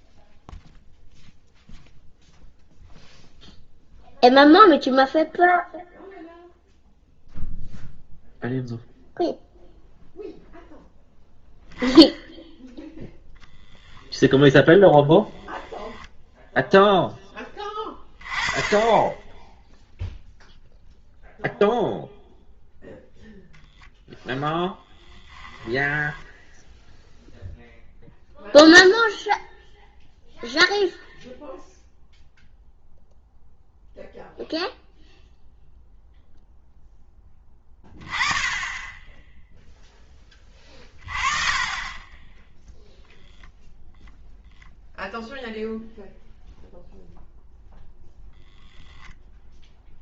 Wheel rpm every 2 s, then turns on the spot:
0, 0, 0, 0, 0, 0, 0, 10, 0, 20, 0, 0, 10, 0, 0, 0, 0, 0, 0, 20, 20, 0, 0, 0, 0.
24-26